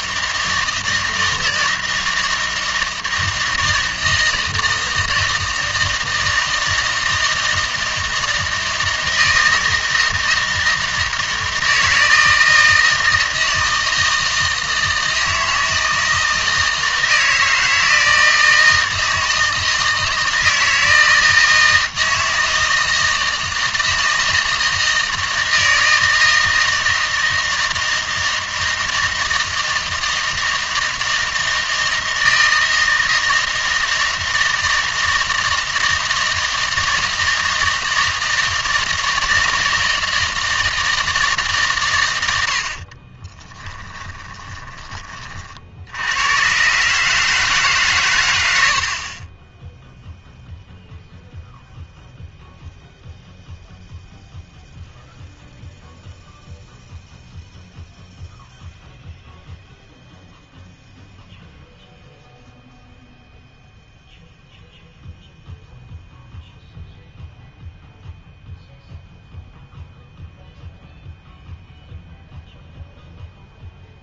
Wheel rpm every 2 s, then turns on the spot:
160, 160, 160, 160, 160, 160, 160, 160, 160, 160, 160, 160, 160, 160, 160, 160, 160, 160, 160, 160, 160, 70, 30, 140, 70, 0, 0, 0, 0, 0, 0, 0, 0, 0, 0, 0, 0.
42-46